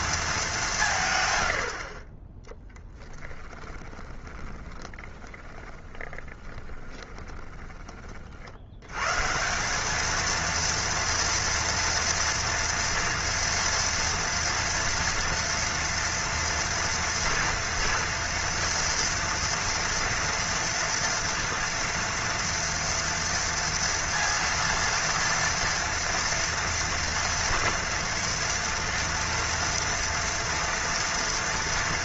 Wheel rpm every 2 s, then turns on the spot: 210, 10, 20, 20, 80, 230, 230, 230, 240, 240, 230, 230, 230, 240, 230, 230.
4-8